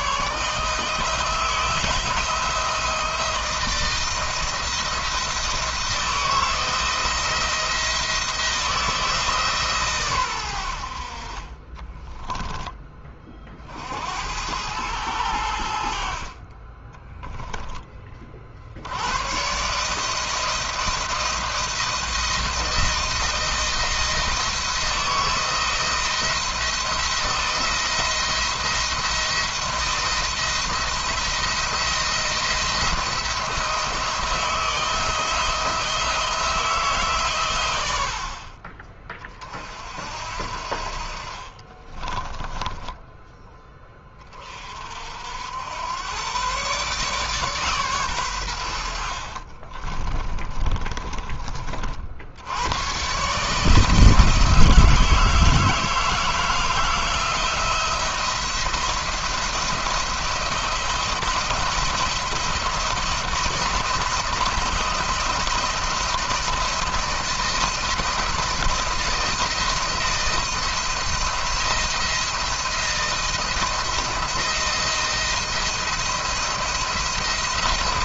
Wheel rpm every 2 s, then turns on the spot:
160, 170, 170, 170, 170, 100, 10, 90, 40, 60, 160, 170, 160, 170, 170, 170, 170, 160, 160, 40, 60, 30, 30, 120, 110, 30, 90, 160, 160, 170, 170, 170, 160, 160, 160, 160, 170, 170, 170.
42-44 50-52